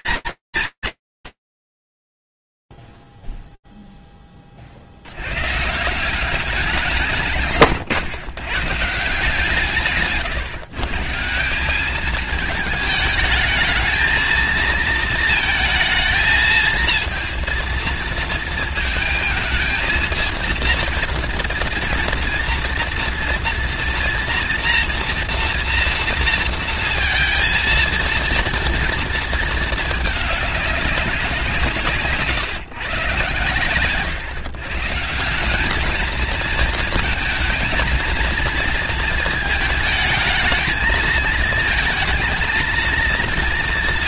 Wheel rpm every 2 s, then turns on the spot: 250, 60, 30, 190, 130, 140, 220, 230, 220, 220, 230, 230, 230, 230, 230, 210, 140, 120, 220, 230, 220, 220.
none